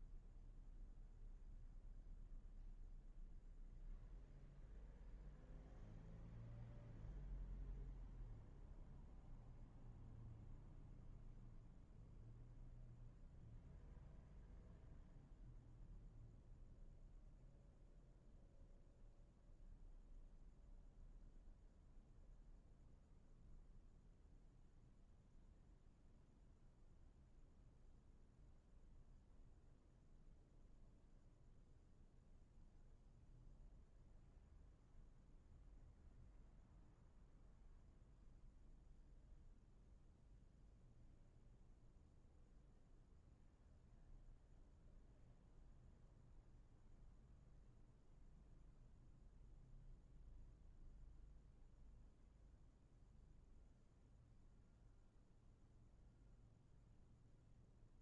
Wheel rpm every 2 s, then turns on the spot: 0, 0, 0, 0, 0, 0, 0, 0, 0, 0, 0, 0, 0, 0, 0, 0, 0, 0, 0, 0, 0, 0, 0, 0, 0, 0, 0, 0, 0.
none